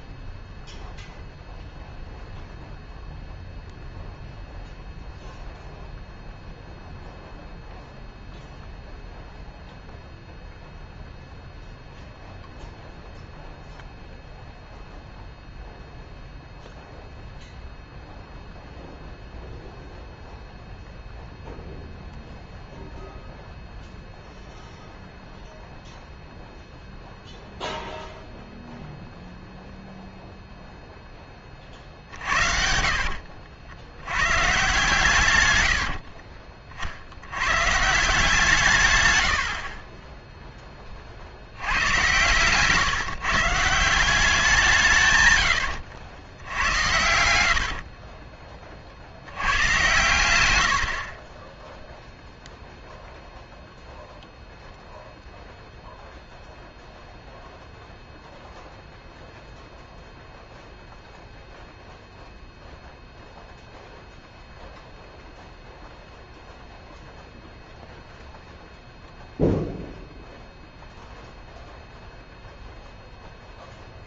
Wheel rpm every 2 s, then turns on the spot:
0, 0, 0, 0, 0, 0, 0, 0, 0, 0, 0, 0, 0, 0, 0, 0, 50, 140, 50, 130, 10, 140, 170, 100, 30, 40, 0, 0, 0, 0, 0, 0, 0, 0, 0, 0, 0.
32-34 46-48